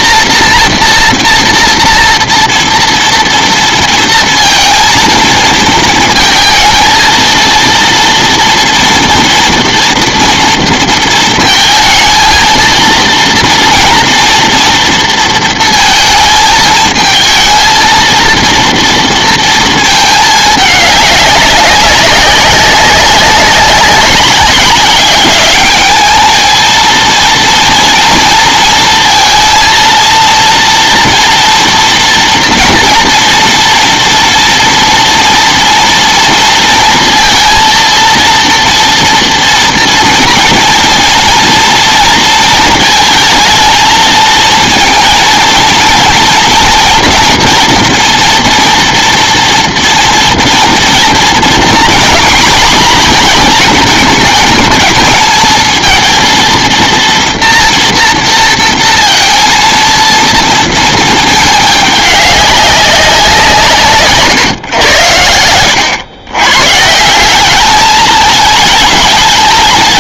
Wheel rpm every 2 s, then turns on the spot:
230, 230, 230, 220, 240, 230, 230, 230, 220, 230, 210, 190, 200, 220, 220, 230, 240, 230, 230, 240, 240, 220, 230, 230, 230, 230, 240, 220, 230, 230, 230, 190, 110, 130, 220.
none